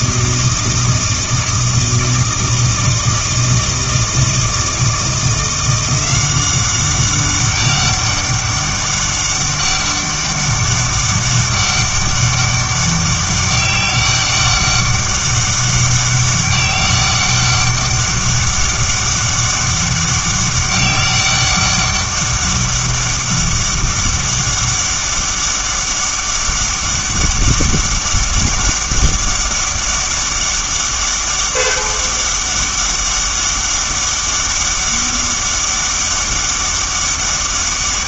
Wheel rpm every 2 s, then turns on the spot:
160, 160, 160, 190, 200, 200, 200, 200, 200, 200, 200, 200, 200, 200, 200, 200, 200, 200, 200.
none